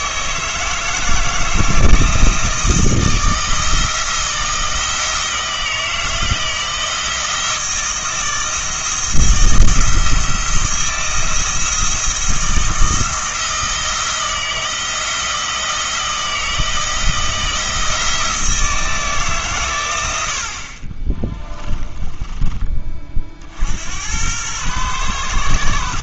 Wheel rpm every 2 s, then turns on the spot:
160, 160, 170, 170, 160, 170, 170, 160, 160, 160, 50, 30, 110.
none